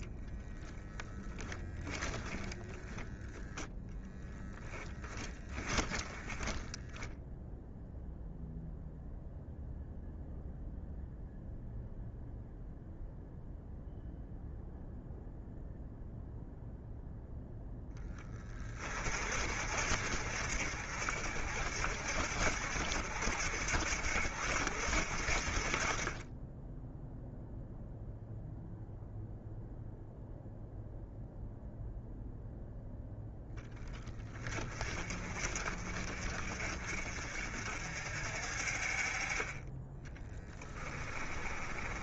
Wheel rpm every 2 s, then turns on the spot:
0, 0, 10, 10, 0, 0, 0, 0, 0, 30, 60, 70, 60, 10, 0, 0, 10, 40, 50, 40, 20.
4-8 26-28 40-42